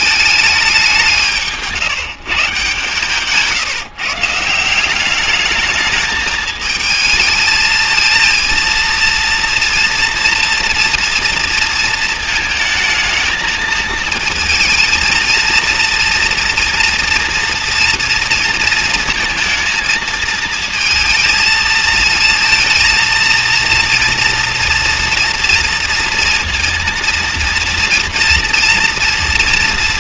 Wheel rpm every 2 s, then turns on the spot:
190, 150, 200, 220, 230, 240, 220, 230, 240, 220, 220, 230, 230, 240, 230.
none